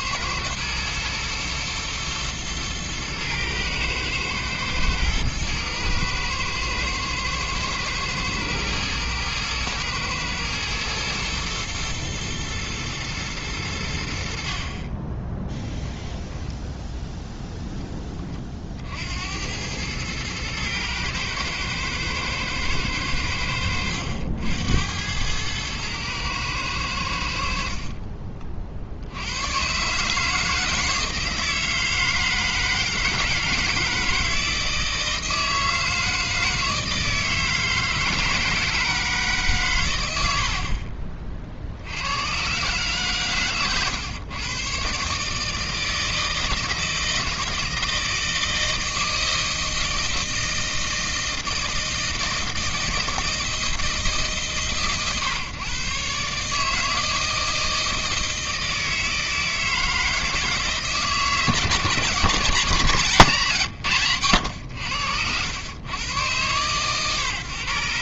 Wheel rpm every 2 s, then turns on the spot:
110, 110, 110, 110, 110, 110, 110, 30, 10, 60, 110, 110, 90, 100, 60, 160, 160, 160, 160, 160, 40, 140, 140, 160, 160, 160, 160, 130, 160, 160, 160, 170, 90, 120.
none